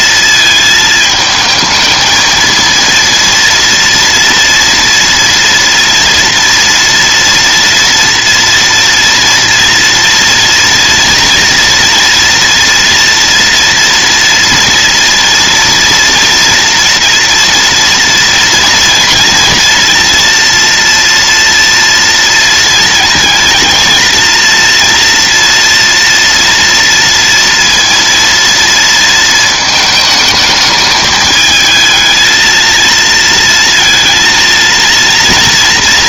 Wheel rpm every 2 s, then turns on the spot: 220, 230, 230, 240, 230, 230, 230, 230, 230, 230, 230, 220, 230, 230, 230, 210, 230, 230.
none